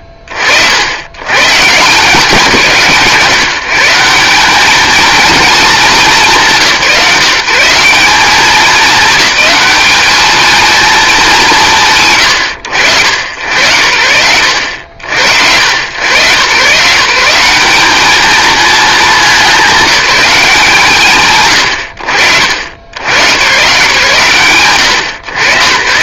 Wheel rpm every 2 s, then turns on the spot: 60, 160, 200, 170, 200, 220, 100, 70, 120, 210, 170, 70, 120.
none